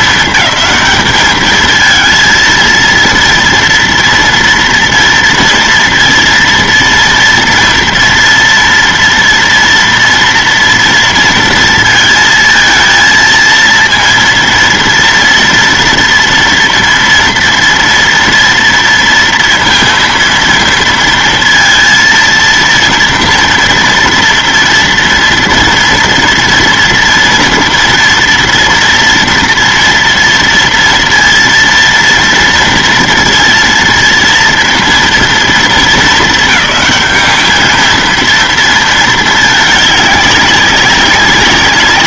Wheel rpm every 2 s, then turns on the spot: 220, 230, 230, 230, 230, 230, 230, 230, 240, 230, 230, 230, 230, 230, 240, 230, 230, 230, 220, 230, 200.
none